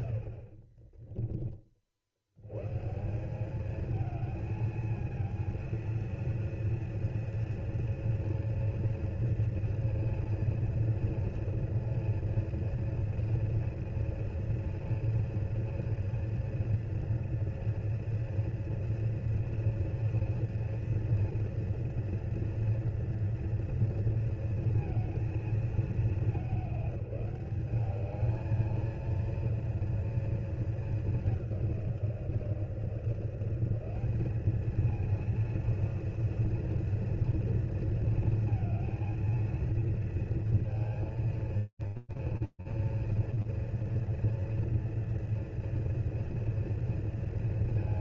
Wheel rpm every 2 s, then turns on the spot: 30, 150, 220, 230, 230, 230, 230, 240, 230, 230, 230, 230, 230, 200, 220, 220, 170, 220, 230, 230, 230, 230, 230, 220.
0-2